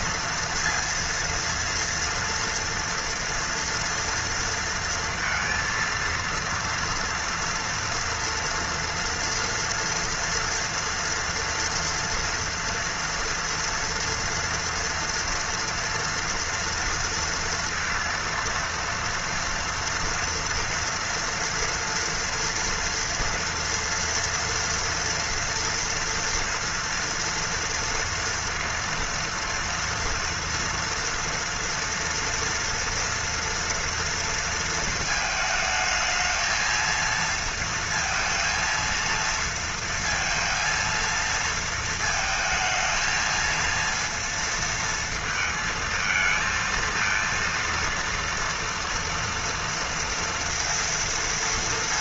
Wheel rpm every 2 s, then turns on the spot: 230, 240, 230, 230, 230, 230, 230, 230, 230, 230, 230, 230, 230, 240, 230, 230, 240, 220, 230, 230, 230, 220, 230, 230, 230, 230.
none